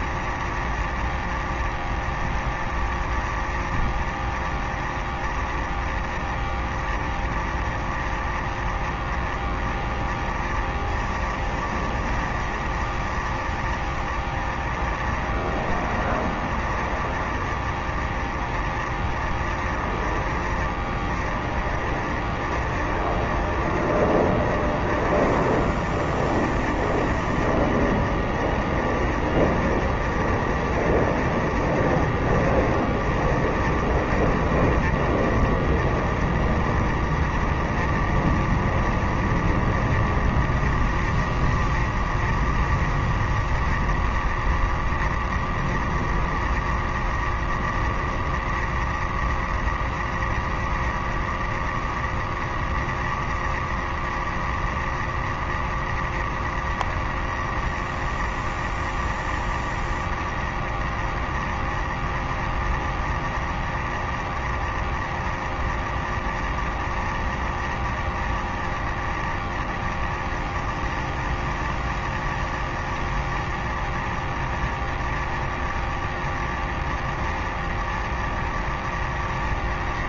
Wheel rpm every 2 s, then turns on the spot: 0, 0, 0, 0, 0, 0, 0, 0, 0, 0, 0, 0, 0, 0, 0, 0, 0, 0, 0, 0, 0, 0, 0, 0, 0, 0, 0, 0, 0, 0, 0, 0, 0, 0, 0, 0, 0, 0, 0, 0.
none